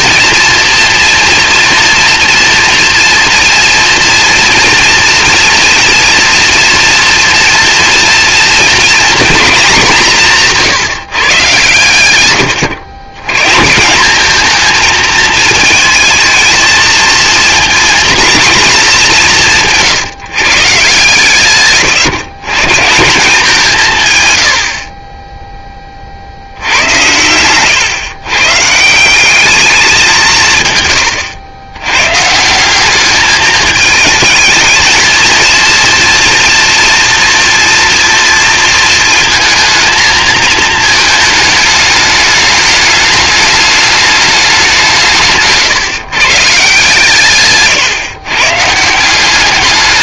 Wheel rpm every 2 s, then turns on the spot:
230, 240, 240, 230, 230, 180, 100, 220, 220, 220, 140, 150, 60, 90, 150, 140, 180, 220, 230, 230, 220, 210, 180, 150, 160.
26-28